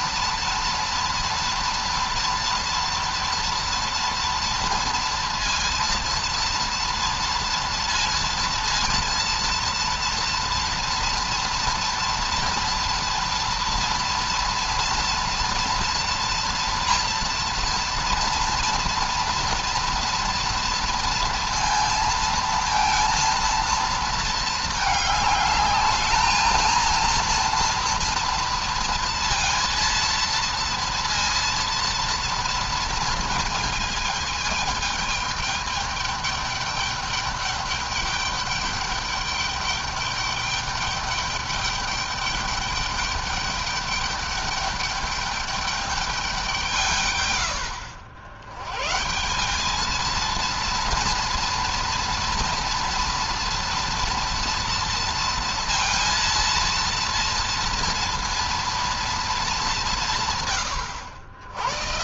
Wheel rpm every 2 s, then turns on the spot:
230, 240, 230, 230, 230, 230, 240, 230, 230, 230, 230, 230, 220, 220, 230, 230, 230, 220, 210, 200, 210, 200, 200, 160, 120, 230, 240, 230, 230, 230, 110.
none